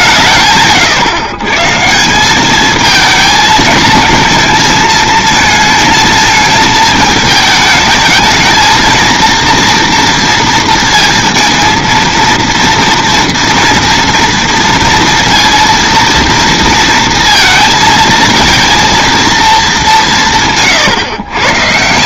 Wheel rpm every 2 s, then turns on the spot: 140, 210, 230, 220, 220, 230, 230, 230, 230, 230, 130.
none